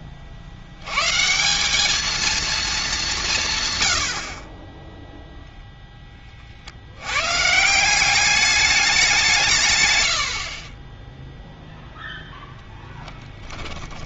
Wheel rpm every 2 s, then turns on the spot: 80, 220, 20, 60, 210, 40, 0.
none